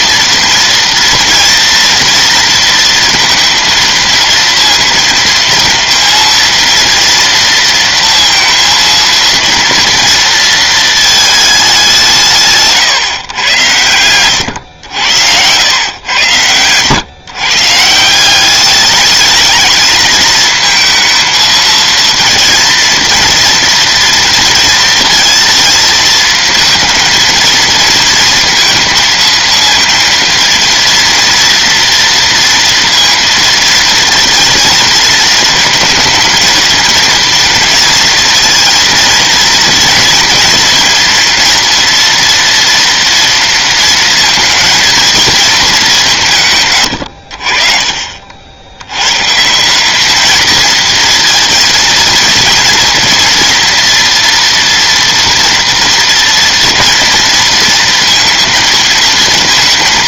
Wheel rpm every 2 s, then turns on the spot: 230, 230, 230, 230, 230, 230, 180, 100, 120, 170, 220, 230, 230, 220, 230, 230, 230, 230, 220, 230, 230, 230, 230, 180, 50, 210, 230, 230, 230, 230.
none